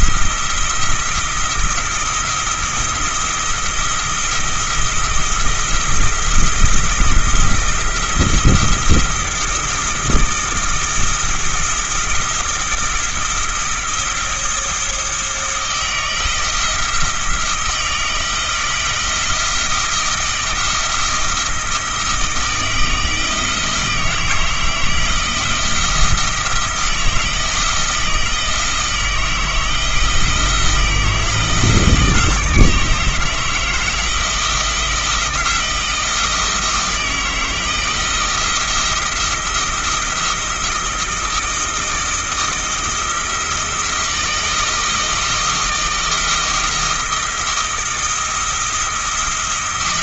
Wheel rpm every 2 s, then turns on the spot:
170, 170, 170, 170, 170, 170, 170, 170, 170, 160, 170, 160, 160, 160, 160, 170, 160, 170, 170, 170, 170, 160, 160, 170, 170.
none